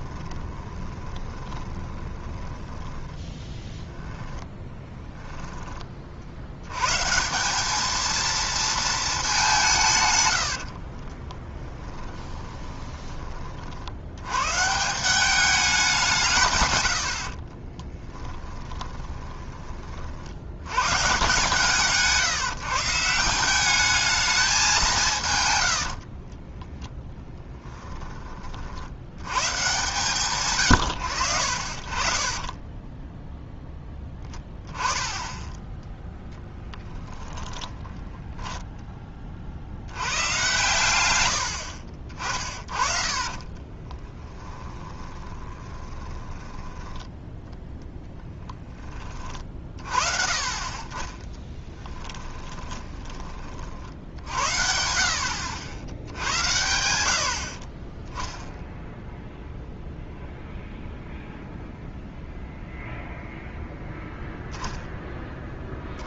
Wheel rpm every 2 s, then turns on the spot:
20, 10, 20, 120, 220, 50, 20, 170, 100, 20, 120, 160, 190, 10, 70, 100, 20, 10, 10, 10, 120, 40, 20, 10, 20, 30, 10, 60, 90, 0, 0, 0, 0.
0-2 4-6 10-14 18-20 26-28 36-38 42-46 52-54